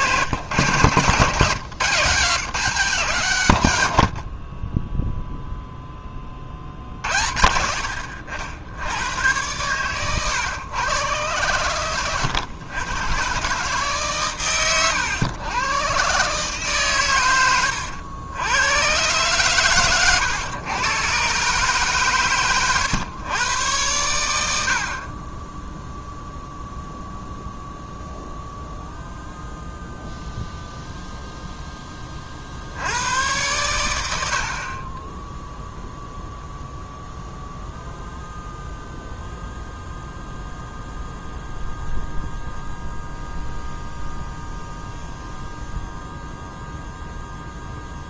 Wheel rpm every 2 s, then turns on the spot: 140, 160, 30, 50, 80, 120, 120, 120, 130, 100, 110, 120, 80, 0, 0, 0, 60, 50, 0, 0, 0, 0, 0, 0.
none